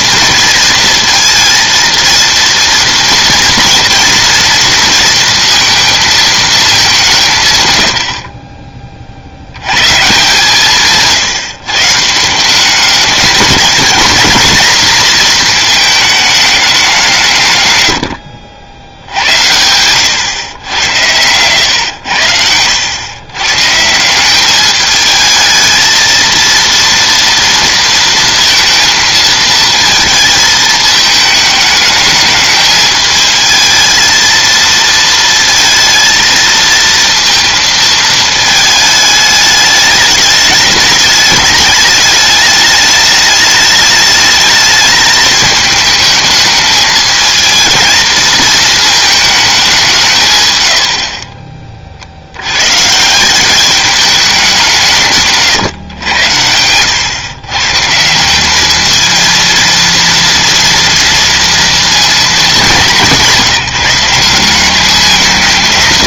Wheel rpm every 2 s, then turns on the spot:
230, 230, 230, 210, 30, 150, 180, 220, 200, 70, 100, 90, 210, 230, 230, 220, 210, 230, 230, 220, 210, 210, 220, 220, 220, 100, 120, 180, 90, 210, 230, 200, 190.
none